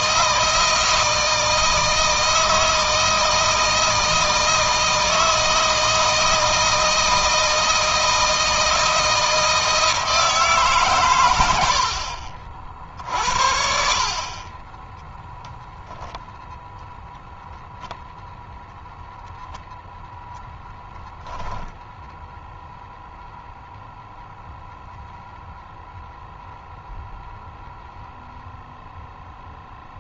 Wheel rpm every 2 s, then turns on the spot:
160, 160, 160, 160, 160, 140, 50, 10, 0, 0, 0, 0, 0, 0, 0.
14-16